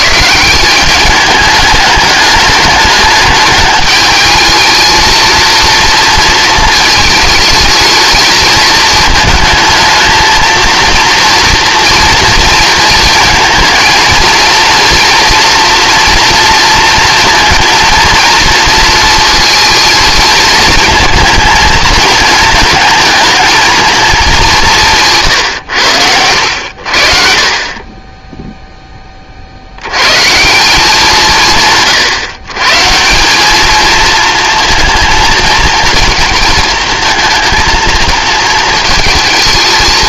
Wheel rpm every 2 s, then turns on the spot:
200, 210, 220, 220, 220, 230, 230, 240, 230, 230, 230, 220, 150, 60, 10, 180, 150, 230, 230, 220.
none